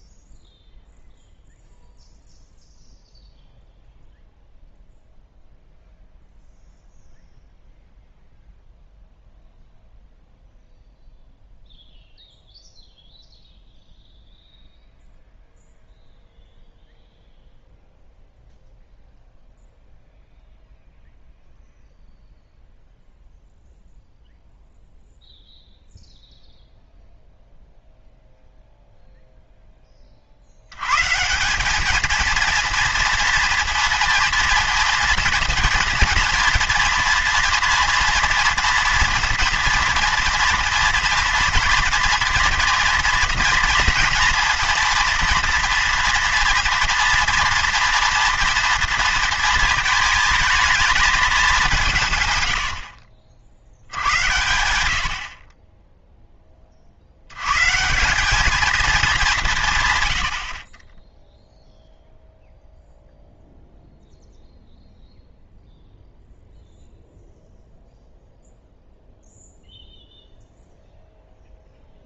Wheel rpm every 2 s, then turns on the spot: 0, 0, 0, 0, 0, 0, 0, 0, 0, 0, 0, 0, 0, 0, 0, 80, 230, 240, 230, 230, 230, 230, 230, 240, 230, 220, 90, 90, 30, 210, 40, 0, 0, 0, 0, 0.
52-54